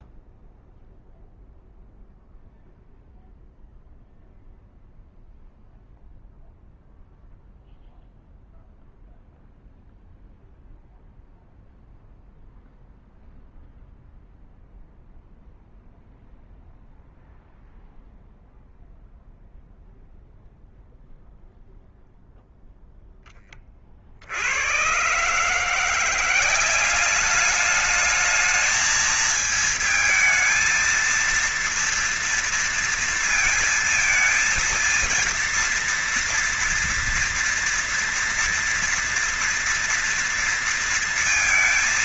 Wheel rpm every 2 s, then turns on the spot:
0, 0, 0, 0, 0, 0, 0, 0, 0, 0, 0, 0, 60, 180, 220, 220, 230, 230, 230, 230, 230.
none